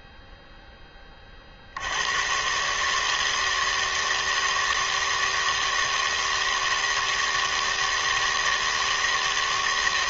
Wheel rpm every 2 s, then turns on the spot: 70, 160, 160, 160, 160.
none